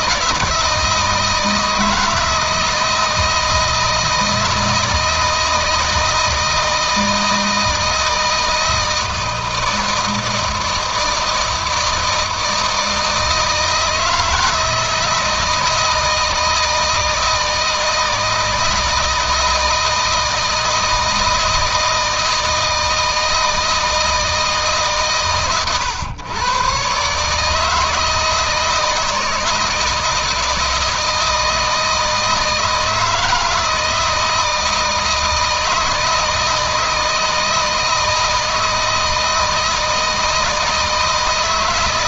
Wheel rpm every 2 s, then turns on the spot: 160, 160, 160, 160, 160, 160, 160, 160, 160, 160, 160, 160, 150, 130, 160, 170, 160, 160, 160, 160, 160.
none